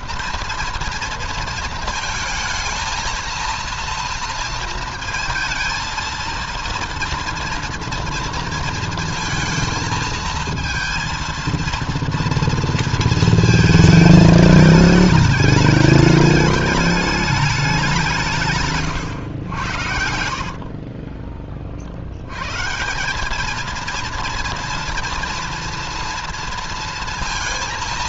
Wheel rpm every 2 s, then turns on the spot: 230, 220, 230, 230, 230, 230, 230, 210, 210, 130, 40, 170, 230, 230.
18-22